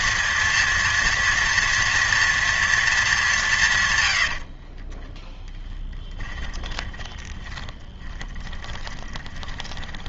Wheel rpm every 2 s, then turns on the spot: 230, 230, 60, 30, 30.
4-10